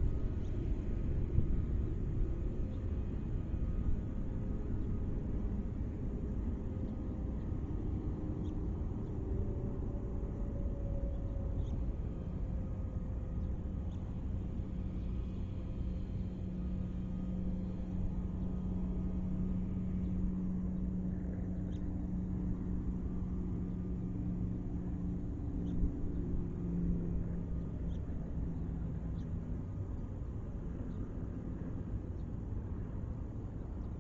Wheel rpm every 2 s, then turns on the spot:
0, 0, 0, 0, 0, 0, 0, 0, 0, 0, 0, 0, 0, 0, 0, 0, 0.
none